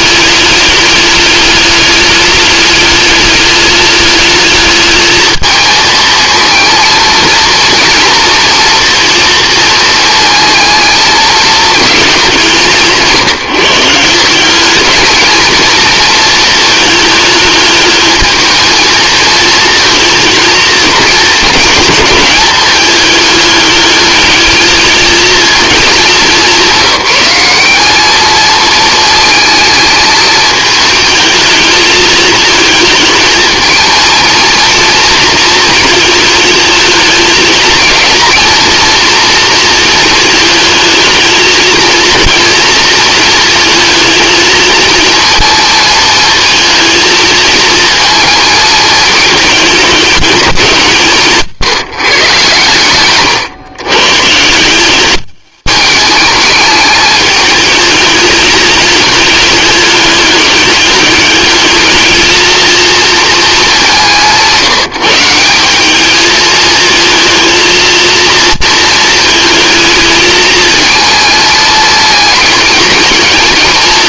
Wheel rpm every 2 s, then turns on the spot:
200, 210, 210, 230, 230, 220, 160, 220, 220, 220, 230, 210, 220, 190, 220, 220, 220, 230, 220, 240, 220, 230, 230, 220, 220, 160, 120, 190, 210, 210, 200, 230, 180, 220, 230, 220, 220.
52-54